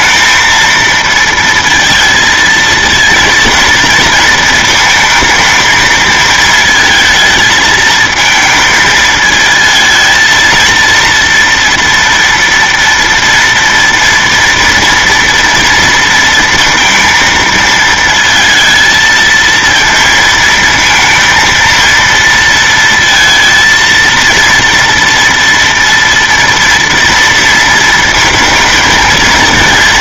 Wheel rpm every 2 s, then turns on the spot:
220, 230, 230, 230, 220, 230, 230, 230, 230, 230, 230, 230, 230, 230, 230.
none